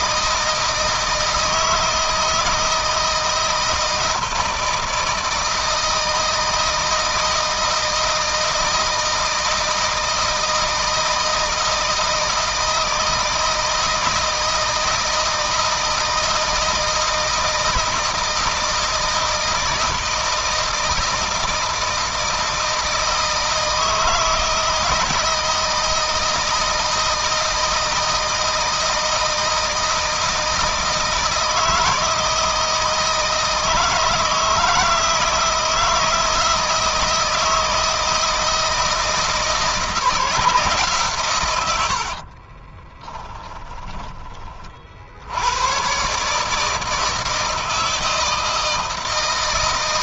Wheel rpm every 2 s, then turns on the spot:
160, 160, 160, 160, 160, 160, 160, 160, 160, 160, 160, 160, 160, 160, 160, 160, 160, 160, 160, 160, 150, 30, 50, 150, 160.
42-44